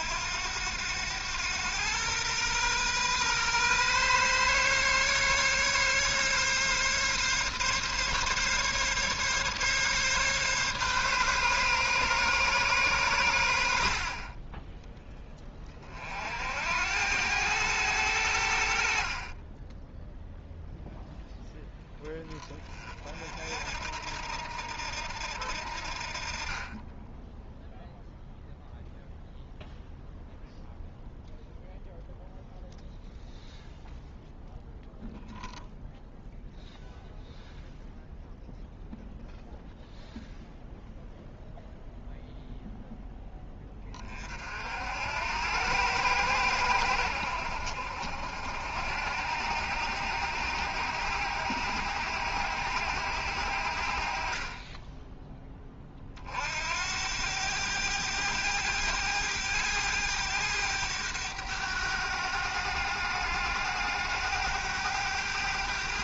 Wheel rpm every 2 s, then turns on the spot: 100, 120, 140, 140, 140, 140, 130, 20, 80, 60, 0, 30, 80, 20, 0, 0, 0, 0, 0, 0, 0, 0, 70, 100, 70, 90, 90, 20, 70, 100, 100, 100, 100.
14-16 18-20 54-56